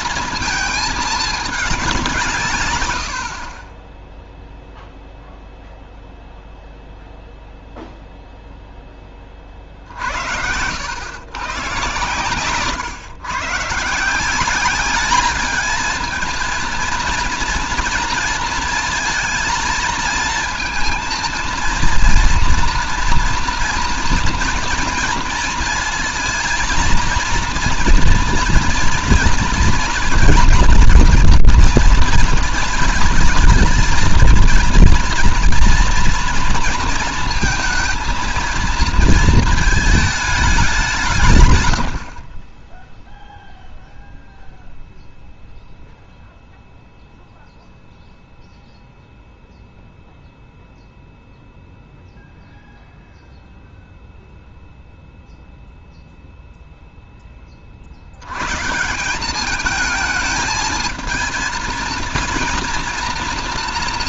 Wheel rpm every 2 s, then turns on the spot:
230, 140, 0, 0, 10, 90, 120, 190, 230, 230, 230, 230, 240, 230, 230, 230, 230, 230, 230, 230, 190, 20, 0, 0, 0, 0, 0, 0, 0, 130, 220, 230.
none